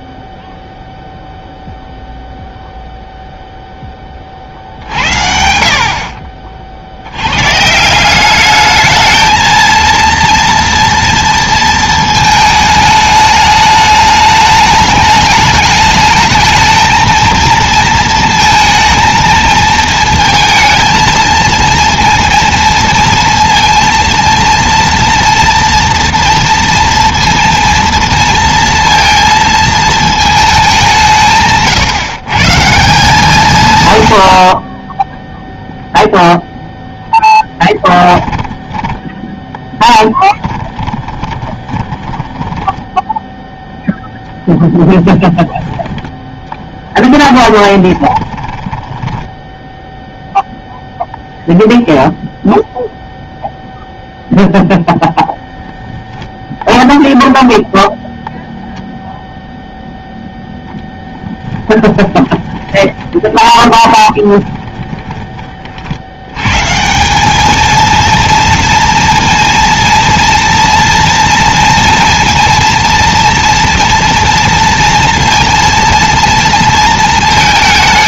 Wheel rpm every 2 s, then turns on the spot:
0, 0, 60, 50, 210, 230, 220, 210, 220, 230, 220, 230, 230, 230, 230, 190, 170, 20, 0, 10, 10, 10, 10, 10, 10, 0, 0, 0, 0, 0, 10, 20, 20, 160, 230, 230, 230, 230, 230.
38-50 62-66